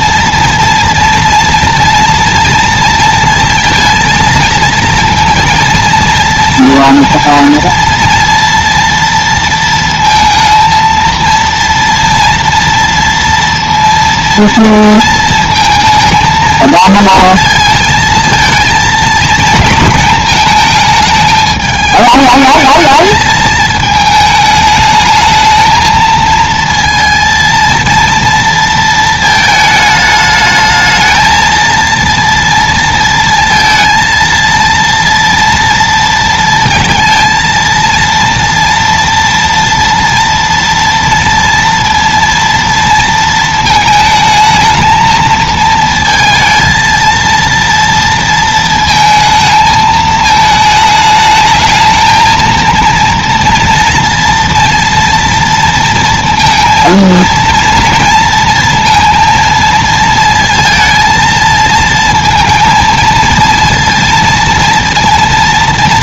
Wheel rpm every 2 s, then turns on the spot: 240, 230, 230, 230, 230, 230, 230, 230, 220, 230, 220, 220, 210, 230, 230, 220, 230, 230, 230, 230, 230, 230, 220, 230, 230, 220, 230, 230, 230, 230, 230, 230, 230.
none